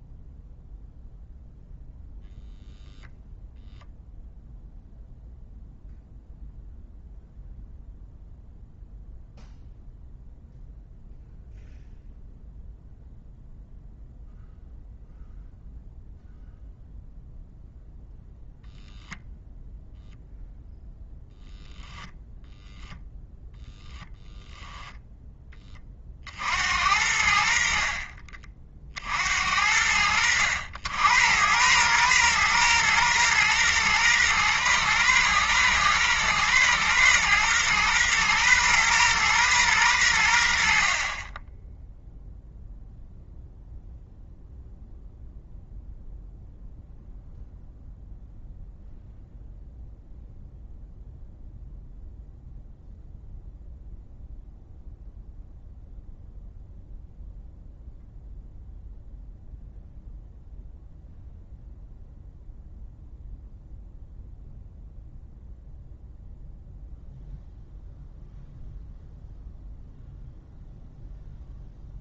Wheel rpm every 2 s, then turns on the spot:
0, 0, 0, 0, 0, 0, 0, 0, 0, 0, 0, 0, 0, 80, 60, 90, 120, 120, 120, 120, 30, 0, 0, 0, 0, 0, 0, 0, 0, 0, 0, 0, 0, 0, 0, 0.
none